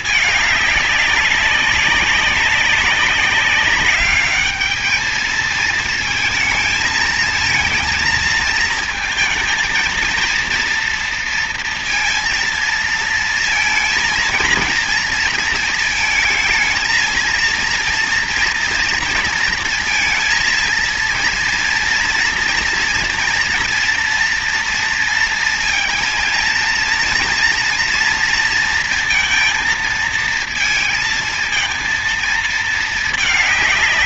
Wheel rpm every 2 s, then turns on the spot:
210, 200, 210, 230, 230, 230, 230, 230, 230, 230, 230, 240, 230, 230, 230, 220, 220.
none